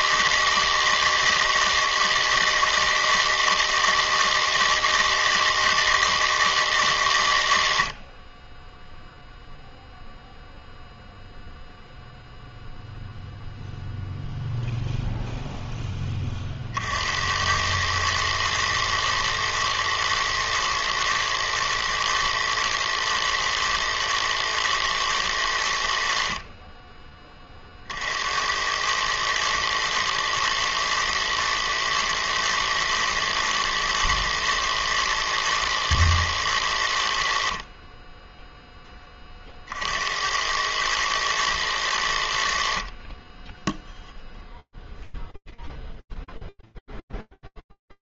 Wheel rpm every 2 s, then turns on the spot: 160, 160, 160, 160, 10, 0, 0, 0, 70, 110, 110, 120, 110, 20, 110, 110, 110, 110, 70, 30, 110, 20, 0, 0.
none